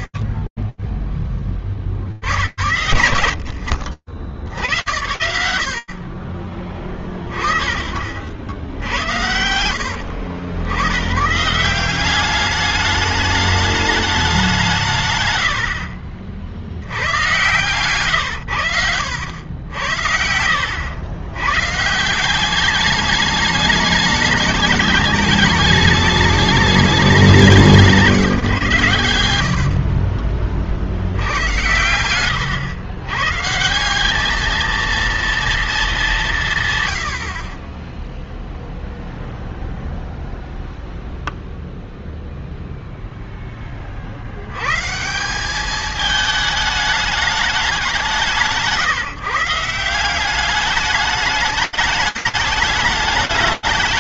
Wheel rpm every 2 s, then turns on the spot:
40, 50, 80, 50, 80, 200, 190, 40, 130, 80, 160, 210, 210, 150, 40, 110, 190, 210, 20, 0, 0, 70, 220, 160, 180, 210, 200.
28-30